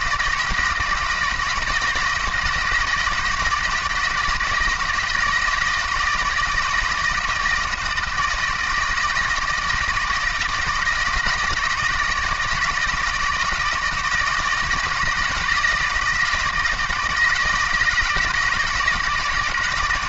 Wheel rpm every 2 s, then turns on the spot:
160, 160, 160, 160, 160, 160, 160, 170, 160, 160.
none